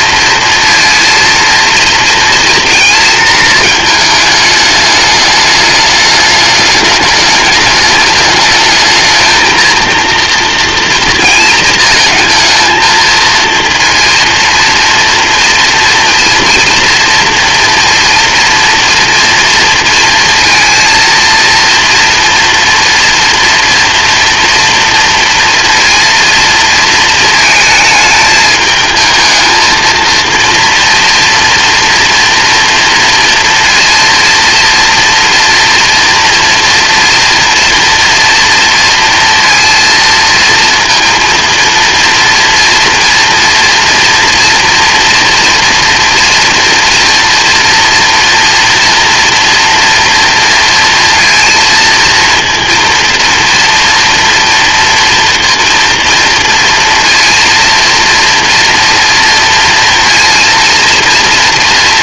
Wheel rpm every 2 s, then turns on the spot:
230, 230, 220, 210, 210, 230, 220, 230, 230, 230, 230, 230, 230, 230, 220, 230, 230, 230, 230, 230, 230, 240, 240, 230, 230, 230, 230, 240, 230, 230, 230.
none